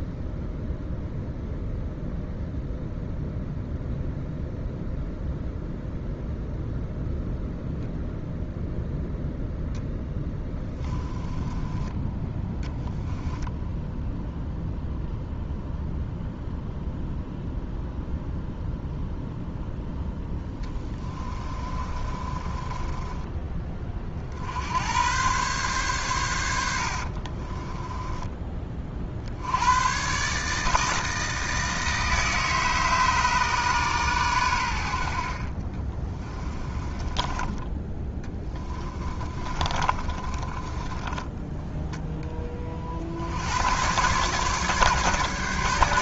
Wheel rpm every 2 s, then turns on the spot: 0, 0, 0, 0, 0, 10, 10, 0, 0, 0, 20, 20, 90, 70, 40, 160, 150, 80, 20, 20, 20, 50, 140.
10-14 20-24 26-28 36-42